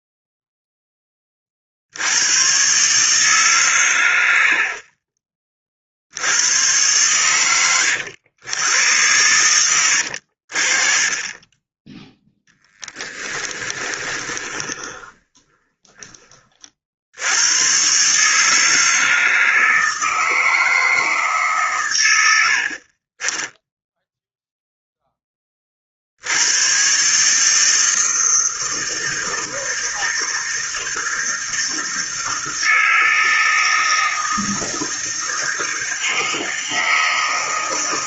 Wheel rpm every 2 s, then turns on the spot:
0, 110, 70, 90, 100, 50, 10, 20, 40, 150, 160, 60, 0, 90, 160, 160, 160, 160, 160.
12-16